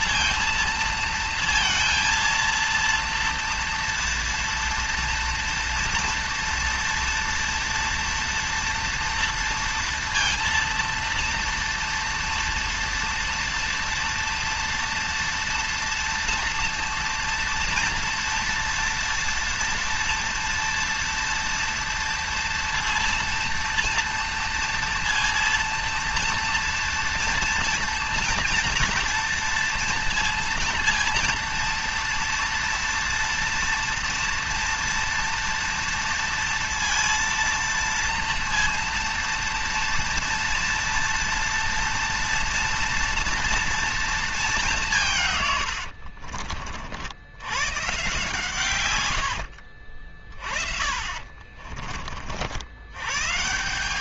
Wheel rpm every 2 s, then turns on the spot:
230, 230, 230, 230, 230, 230, 230, 230, 230, 230, 230, 230, 230, 230, 230, 230, 230, 230, 230, 230, 230, 230, 190, 70, 130, 40, 90.
50-52